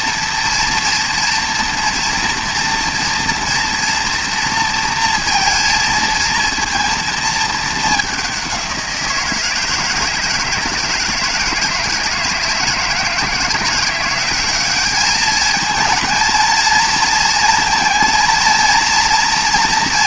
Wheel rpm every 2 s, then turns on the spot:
230, 230, 230, 220, 170, 160, 160, 200, 230, 230.
none